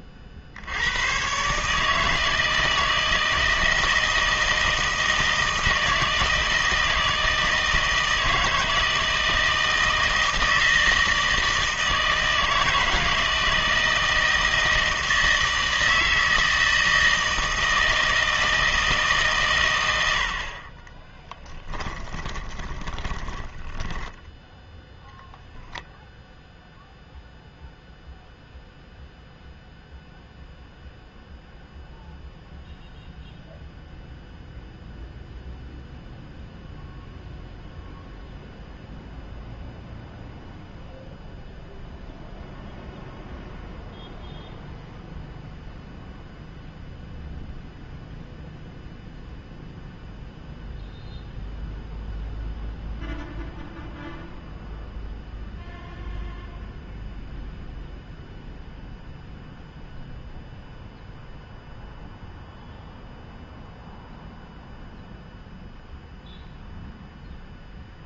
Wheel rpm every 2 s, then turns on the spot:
70, 160, 160, 160, 160, 160, 160, 160, 160, 160, 40, 20, 10, 0, 0, 0, 0, 0, 0, 0, 0, 0, 0, 0, 0, 0, 0, 0, 0, 0, 0, 0, 0, 0.
22-24